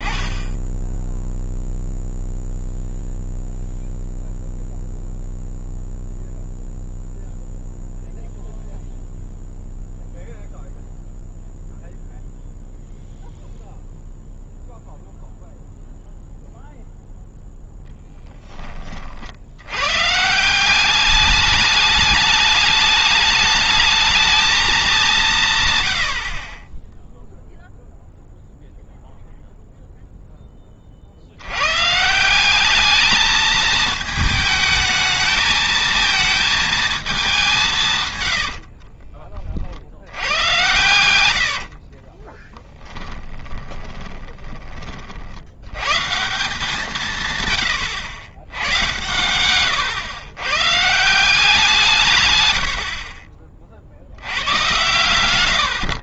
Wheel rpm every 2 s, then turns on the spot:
10, 0, 0, 0, 0, 0, 0, 0, 0, 20, 190, 210, 220, 30, 0, 30, 200, 220, 220, 40, 100, 10, 20, 160, 110, 140, 90, 110.
38-40 42-44